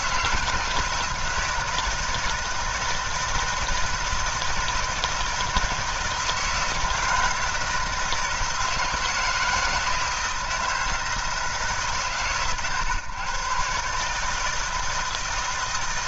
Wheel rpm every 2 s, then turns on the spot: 160, 160, 160, 160, 160, 160, 130, 160.
none